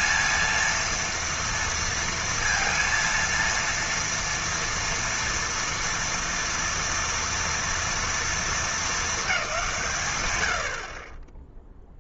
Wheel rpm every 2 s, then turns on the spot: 230, 230, 230, 230, 210, 40.
none